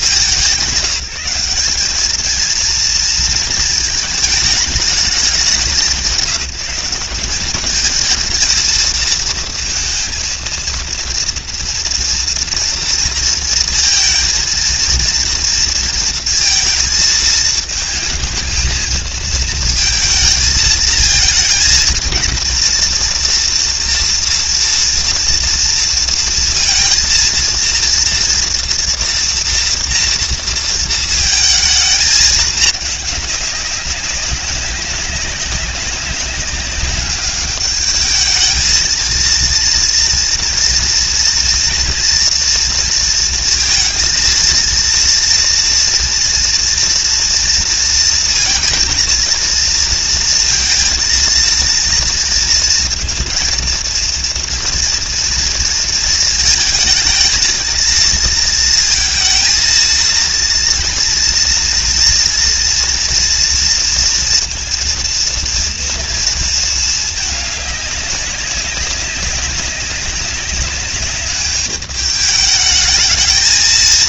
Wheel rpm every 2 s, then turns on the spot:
190, 230, 210, 190, 230, 230, 230, 230, 230, 220, 230, 230, 230, 230, 230, 230, 210, 190, 200, 220, 230, 230, 230, 230, 220, 230, 230, 230, 220, 230, 230, 230, 230, 210, 190, 200, 220.
none